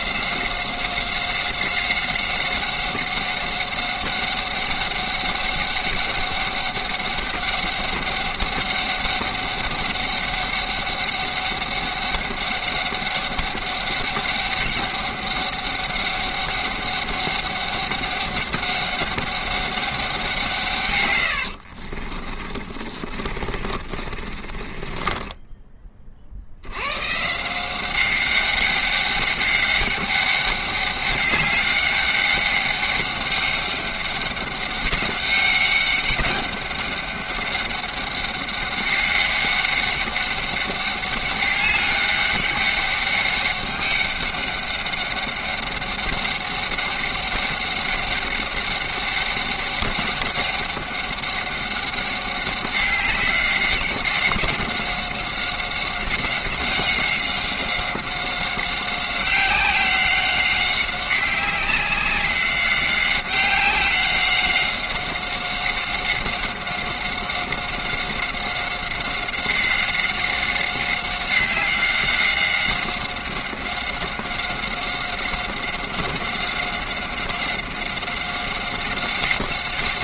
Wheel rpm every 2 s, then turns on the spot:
190, 190, 200, 200, 200, 200, 200, 200, 200, 200, 140, 30, 30, 90, 200, 200, 200, 200, 200, 200, 200, 200, 200, 190, 200, 200, 190, 190, 190, 190, 190, 190, 190, 190, 190, 190, 190, 190, 190, 190.
22-26